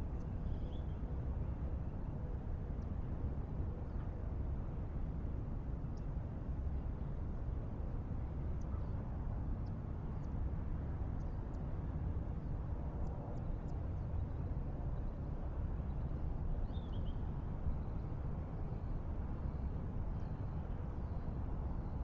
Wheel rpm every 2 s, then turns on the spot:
0, 0, 0, 0, 0, 0, 0, 0, 0, 0, 0.
none